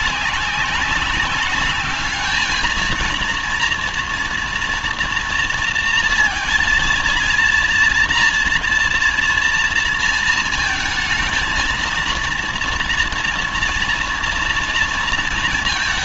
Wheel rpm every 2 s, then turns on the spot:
190, 220, 230, 230, 230, 230, 230, 230.
none